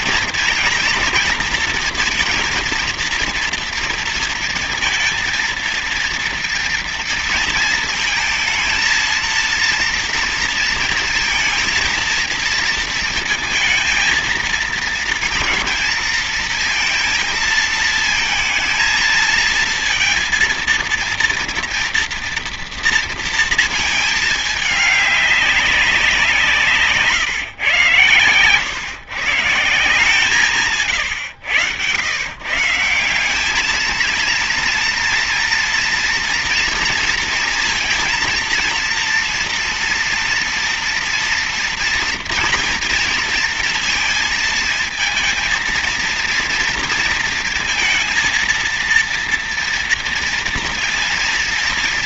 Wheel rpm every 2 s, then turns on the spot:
240, 230, 230, 230, 230, 230, 230, 230, 230, 220, 230, 230, 210, 160, 110, 160, 140, 230, 230, 230, 240, 230, 230, 230, 230, 230.
30-32